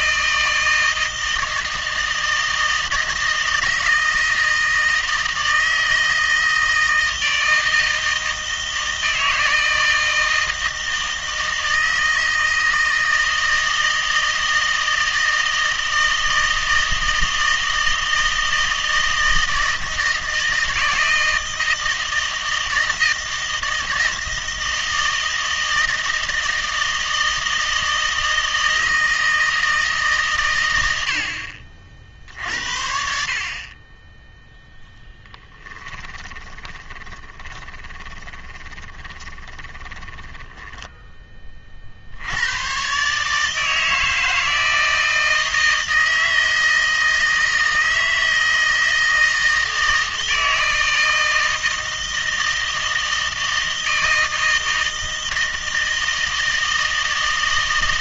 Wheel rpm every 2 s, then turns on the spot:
160, 160, 160, 160, 160, 160, 160, 160, 160, 160, 160, 160, 160, 160, 160, 120, 60, 0, 10, 20, 10, 110, 160, 160, 160, 160, 160, 160, 160.
36-42